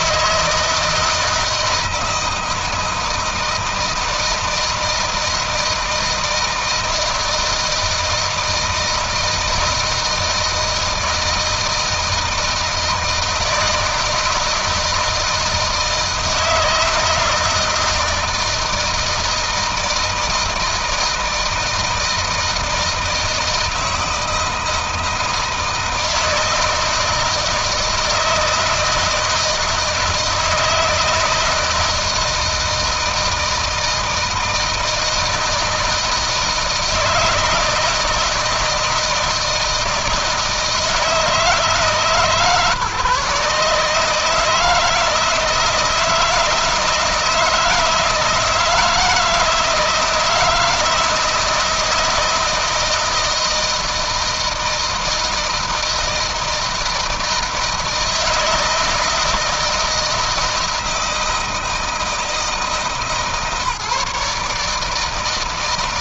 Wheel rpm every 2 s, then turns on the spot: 160, 160, 160, 160, 160, 160, 170, 160, 160, 160, 160, 160, 160, 160, 160, 160, 170, 160, 160, 160, 160, 150, 160, 160, 160, 160, 160, 160, 160, 160, 160, 160, 160.
none